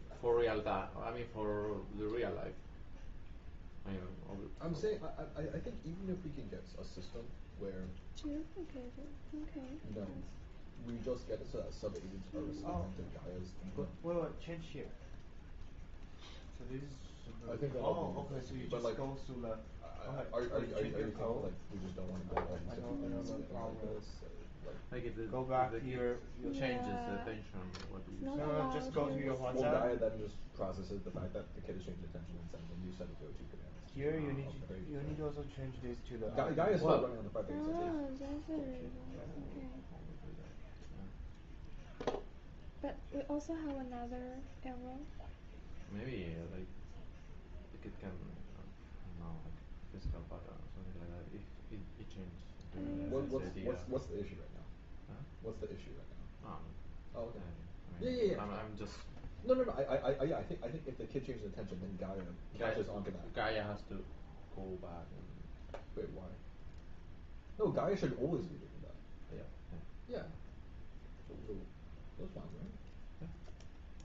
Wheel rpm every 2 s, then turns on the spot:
0, 0, 0, 0, 0, 0, 0, 0, 0, 0, 0, 0, 0, 0, 0, 0, 0, 0, 0, 0, 0, 0, 0, 0, 0, 0, 0, 0, 0, 0, 0, 0, 0, 0, 0, 0, 0.
none